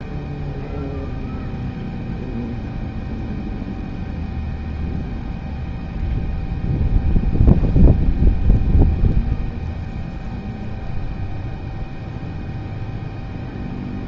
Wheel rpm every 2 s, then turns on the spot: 0, 0, 0, 0, 0, 0, 0.
none